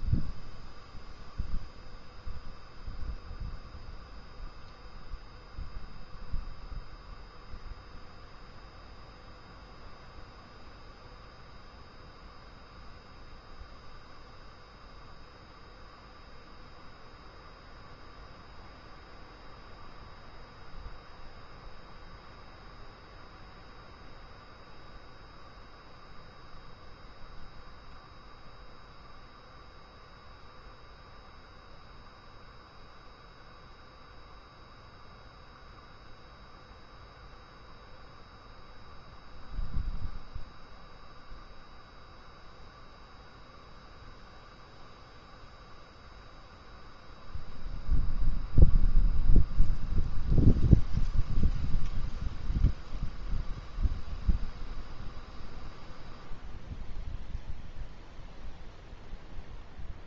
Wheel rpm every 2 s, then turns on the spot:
0, 0, 0, 0, 0, 0, 0, 0, 0, 0, 0, 0, 0, 0, 0, 0, 0, 0, 0, 0, 0, 0, 0, 0, 0, 0, 0, 0, 0, 0.
none